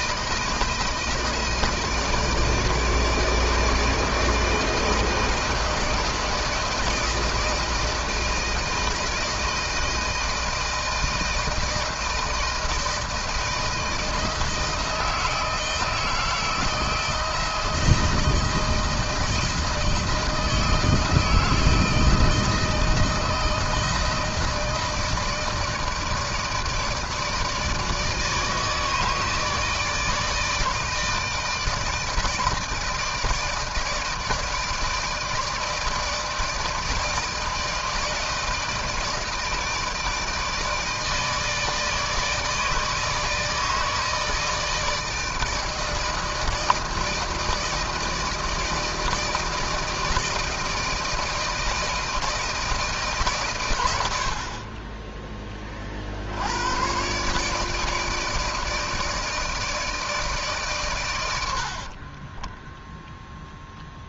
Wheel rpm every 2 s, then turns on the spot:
160, 160, 160, 160, 160, 170, 160, 160, 160, 160, 160, 160, 160, 160, 160, 160, 160, 150, 160, 160, 160, 160, 160, 160, 160, 160, 160, 40, 90, 160, 140, 10.
62-64